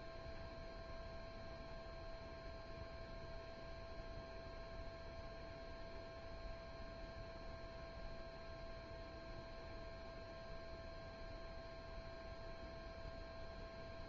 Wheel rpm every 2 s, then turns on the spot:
0, 0, 0, 0, 0, 0, 0.
none